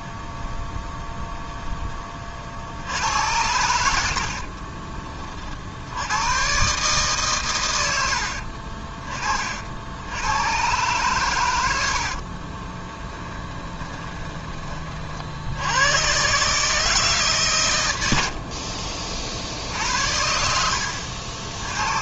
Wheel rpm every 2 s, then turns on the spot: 0, 60, 40, 130, 40, 120, 20, 30, 150, 50, 70.
4-6 8-10 12-14 18-20